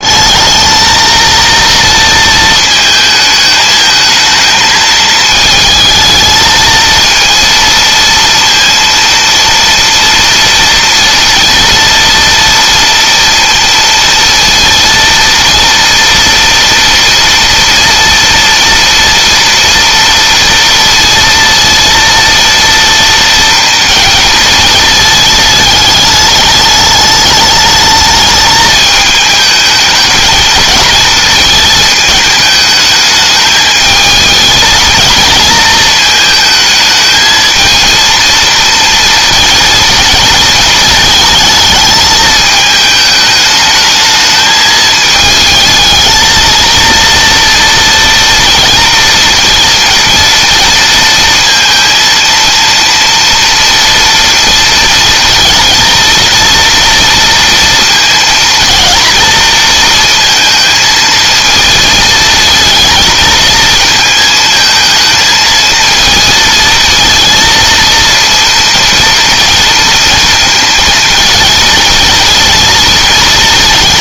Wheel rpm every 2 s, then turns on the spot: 230, 220, 220, 230, 230, 230, 230, 230, 230, 230, 230, 230, 220, 210, 210, 220, 210, 230, 220, 230, 220, 220, 220, 230, 230, 230, 230, 230, 230, 230, 220, 220, 220, 230, 240, 230, 230.
none